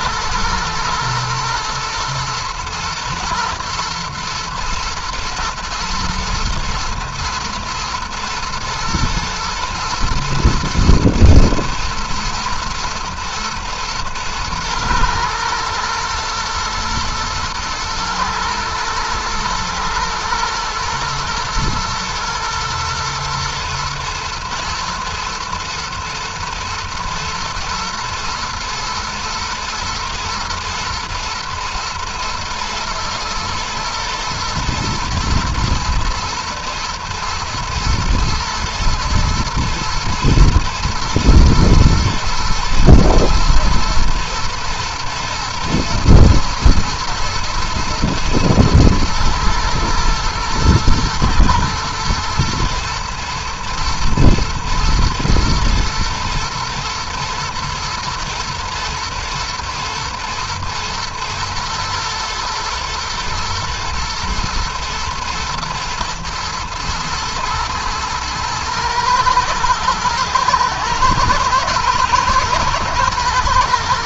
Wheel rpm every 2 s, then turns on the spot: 120, 120, 120, 120, 110, 110, 110, 110, 120, 120, 120, 110, 120, 110, 120, 120, 110, 110, 120, 120, 120, 110, 110, 120, 110, 110, 110, 110, 120, 110, 110, 120, 120, 120, 110, 110, 120.
none